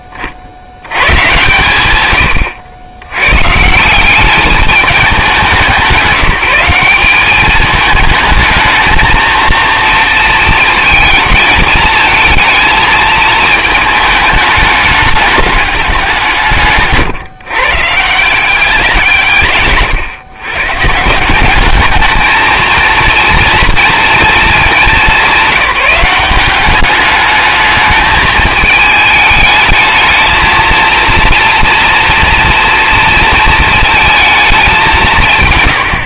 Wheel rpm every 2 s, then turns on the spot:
30, 100, 200, 190, 220, 230, 220, 210, 160, 180, 130, 220, 220, 190, 210, 220, 240, 210.
none